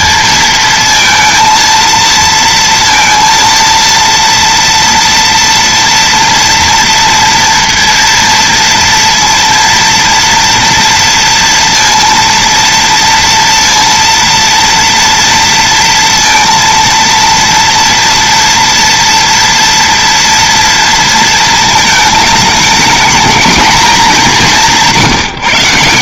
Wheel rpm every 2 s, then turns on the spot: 230, 230, 230, 230, 230, 230, 230, 230, 230, 230, 230, 220, 180.
none